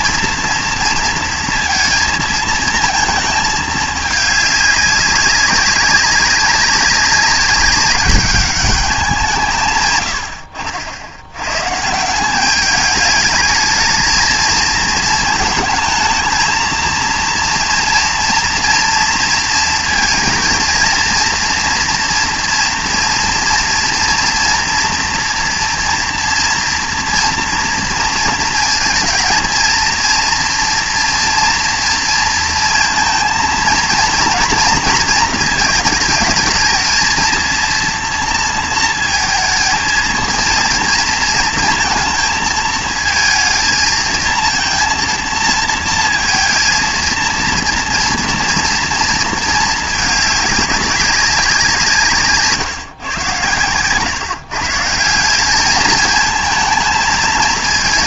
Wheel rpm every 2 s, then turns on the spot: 240, 220, 200, 190, 200, 70, 200, 220, 220, 230, 230, 230, 240, 230, 230, 230, 230, 230, 220, 230, 230, 220, 230, 230, 230, 200, 150, 150, 220.
none